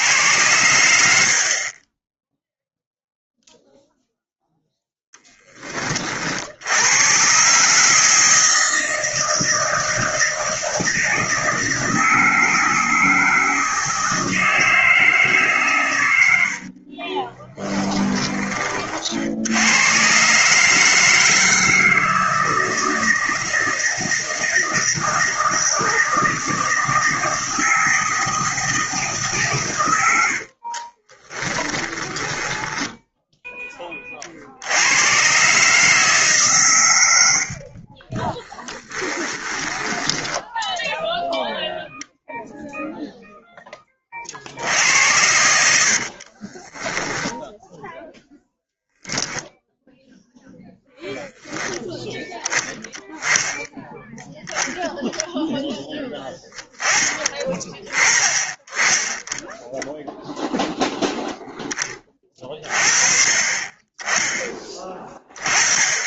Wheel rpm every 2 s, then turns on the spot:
80, 0, 0, 90, 160, 160, 160, 160, 60, 40, 150, 160, 160, 160, 160, 40, 10, 80, 120, 10, 10, 0, 70, 20, 0, 0, 10, 0, 20, 20, 0, 30, 10.
16-18 30-34 38-42 44-48